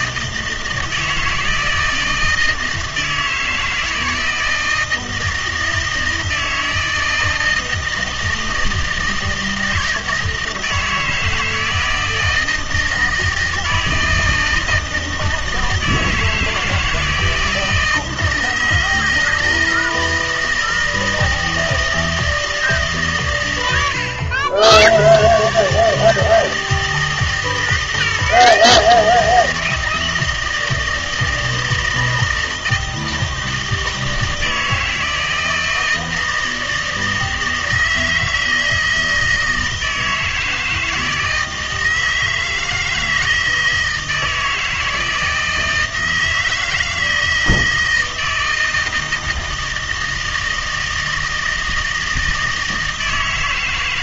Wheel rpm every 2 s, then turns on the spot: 160, 160, 160, 160, 160, 160, 160, 160, 160, 160, 160, 150, 90, 160, 160, 160, 160, 160, 160, 160, 160, 160, 160, 160, 160, 160, 160.
none